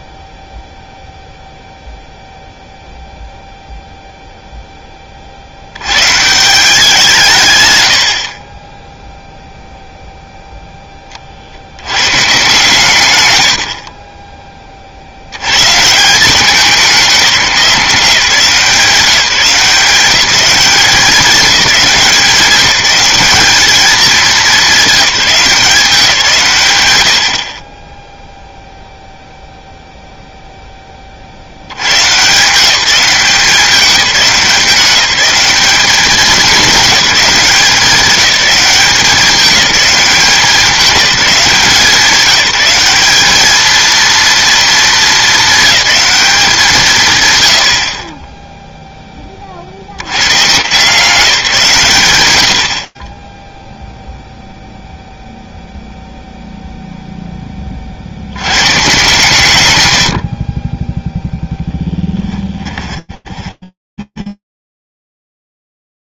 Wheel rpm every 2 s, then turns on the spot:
0, 0, 10, 170, 20, 10, 140, 40, 200, 170, 190, 190, 200, 110, 0, 10, 170, 180, 190, 200, 190, 190, 230, 170, 10, 170, 50, 0, 0, 120, 10, 20, 20.
62-66